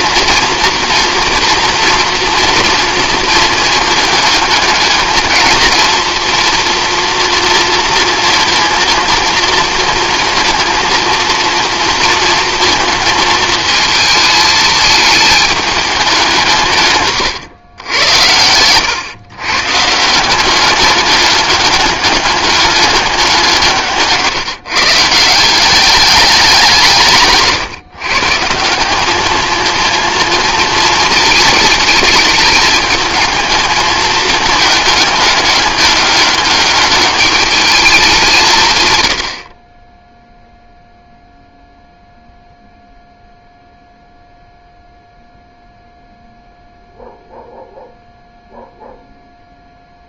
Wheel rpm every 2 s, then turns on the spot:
230, 230, 220, 230, 230, 230, 220, 220, 150, 110, 200, 210, 150, 170, 180, 230, 210, 210, 210, 140, 0, 0, 0, 0, 0.
none